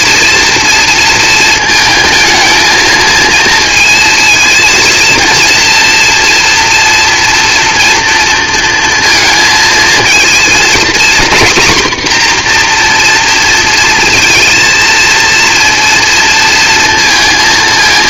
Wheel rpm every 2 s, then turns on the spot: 230, 230, 230, 230, 230, 240, 240, 230, 230.
none